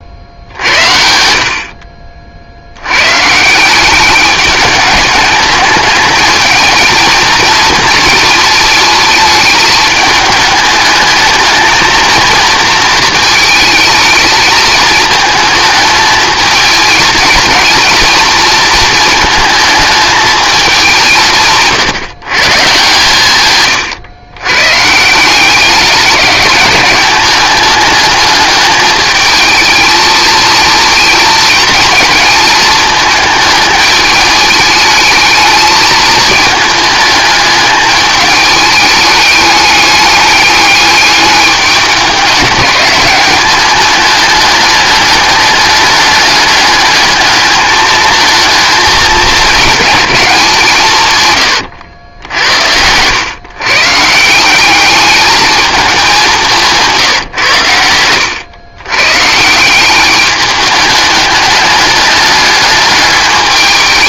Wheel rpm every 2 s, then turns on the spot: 60, 80, 210, 220, 220, 220, 220, 220, 220, 230, 200, 140, 130, 200, 210, 230, 220, 210, 220, 210, 210, 200, 210, 210, 220, 190, 80, 200, 170, 110, 210, 210.
52-54